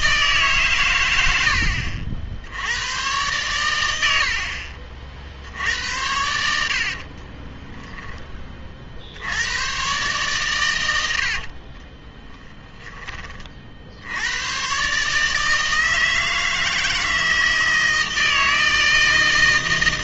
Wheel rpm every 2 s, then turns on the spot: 120, 100, 50, 60, 50, 100, 10, 120, 160, 160.
6-8 12-14